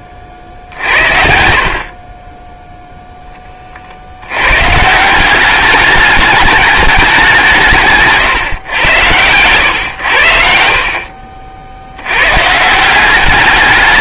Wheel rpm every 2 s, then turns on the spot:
50, 0, 130, 210, 140, 60, 170.
none